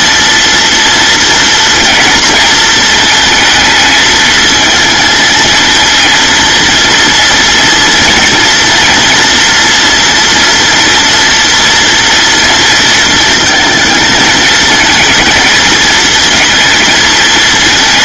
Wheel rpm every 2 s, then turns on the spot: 230, 220, 220, 230, 230, 230, 230, 220, 220.
none